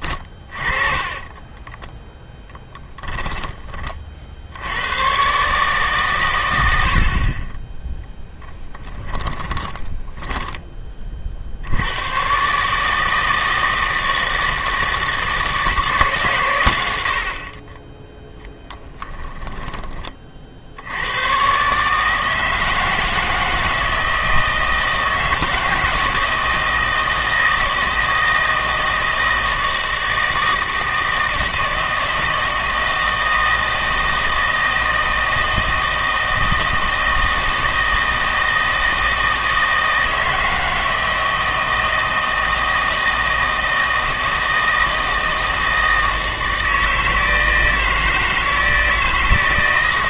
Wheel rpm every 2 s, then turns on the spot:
20, 10, 100, 80, 20, 20, 150, 160, 90, 10, 90, 160, 160, 160, 160, 160, 160, 160, 160, 160, 160, 160, 160, 160, 160.
0-4 8-10 18-20